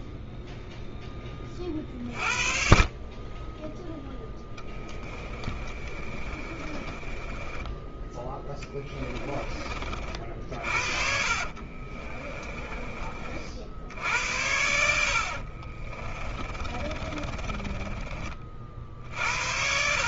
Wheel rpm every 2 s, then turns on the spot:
20, 30, 20, 20, 20, 50, 40, 60, 30, 50.
4-8 10-12 14-18